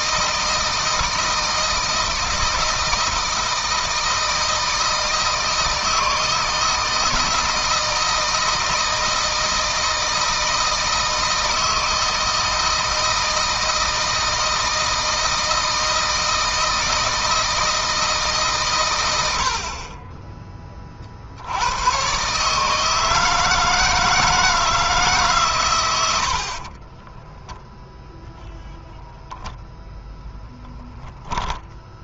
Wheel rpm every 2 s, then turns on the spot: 160, 160, 160, 160, 160, 160, 160, 160, 160, 140, 30, 150, 160, 50, 0, 0.
26-28